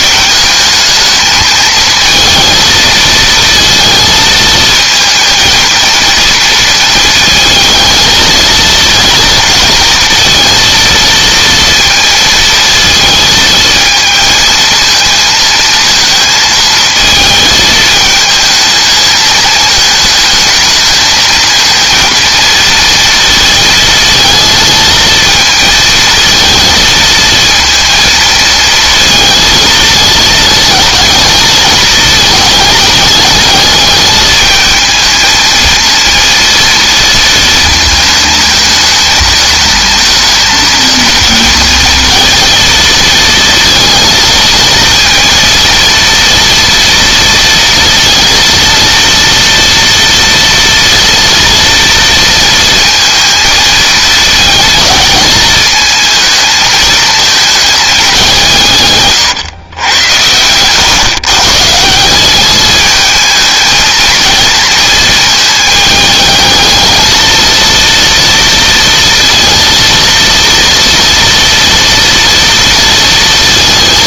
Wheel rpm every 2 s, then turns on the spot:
210, 230, 220, 230, 230, 230, 220, 220, 220, 220, 220, 230, 230, 220, 230, 220, 210, 220, 230, 220, 220, 230, 230, 230, 230, 230, 230, 220, 220, 140, 130, 220, 220, 220, 230, 230, 230.
none